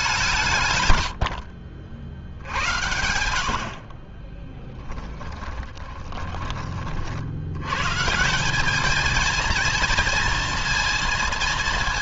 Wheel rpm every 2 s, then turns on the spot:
120, 70, 10, 50, 210, 230.
0-2 4-6